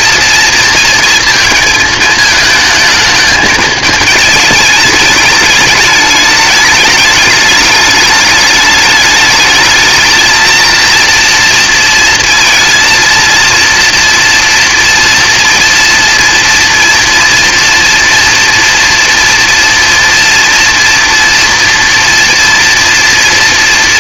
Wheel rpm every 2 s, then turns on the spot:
230, 220, 210, 210, 210, 220, 230, 230, 230, 230, 230, 230.
none